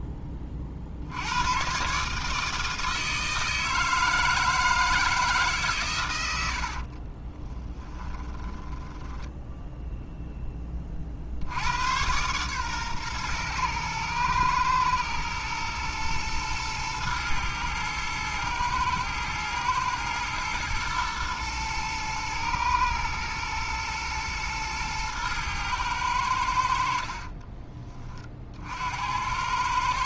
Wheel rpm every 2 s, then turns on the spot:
60, 160, 160, 50, 10, 20, 120, 110, 110, 110, 110, 110, 110, 60, 70.
6-10